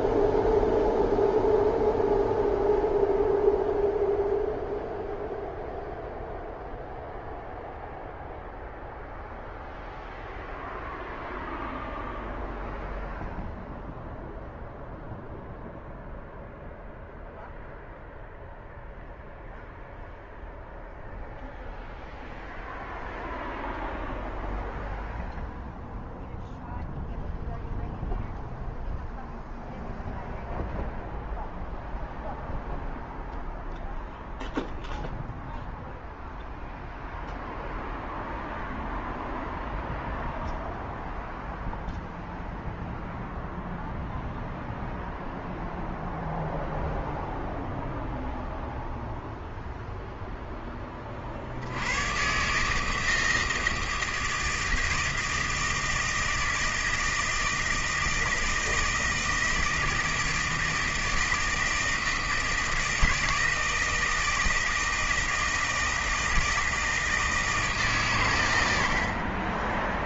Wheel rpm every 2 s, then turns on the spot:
0, 0, 0, 0, 0, 0, 0, 0, 0, 0, 0, 0, 0, 0, 0, 0, 0, 0, 0, 0, 0, 0, 0, 0, 0, 10, 140, 160, 160, 160, 160, 160, 160, 160, 90.
none